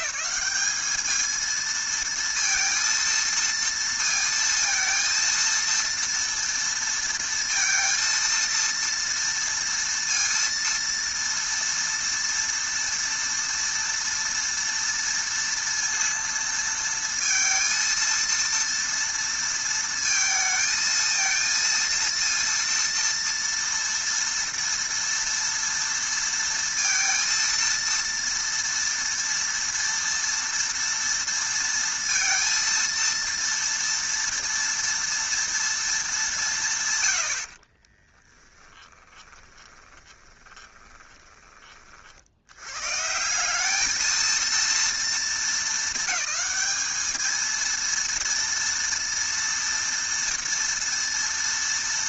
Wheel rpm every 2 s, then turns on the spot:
210, 230, 230, 230, 230, 230, 230, 230, 230, 230, 220, 230, 230, 230, 230, 230, 230, 230, 140, 20, 20, 120, 230, 220, 230, 230.
38-42